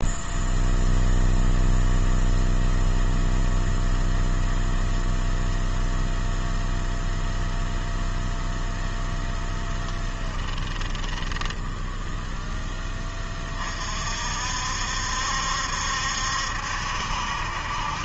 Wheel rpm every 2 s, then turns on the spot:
0, 0, 0, 0, 0, 10, 10, 60, 70.
10-12